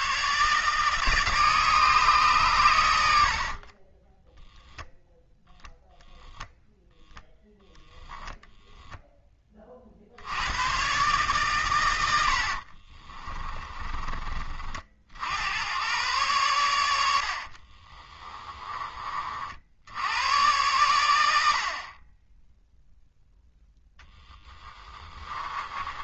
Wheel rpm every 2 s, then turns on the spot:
160, 100, 0, 0, 0, 120, 40, 50, 90, 20, 100, 0, 20.
12-14 24-26